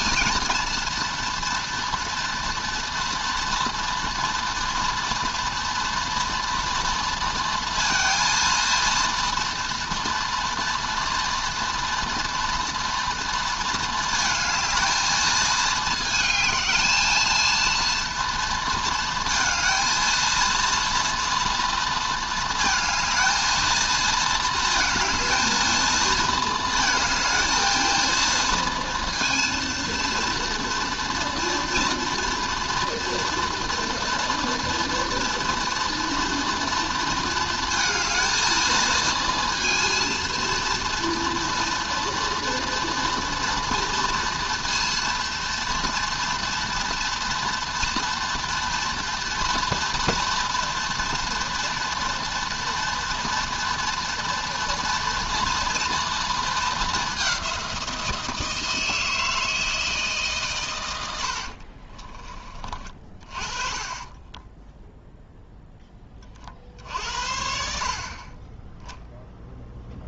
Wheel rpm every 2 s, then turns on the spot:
230, 230, 230, 230, 230, 230, 230, 220, 220, 230, 230, 220, 220, 220, 230, 230, 230, 240, 230, 230, 230, 230, 240, 230, 230, 230, 230, 230, 200, 160, 80, 40, 10, 60, 0.
none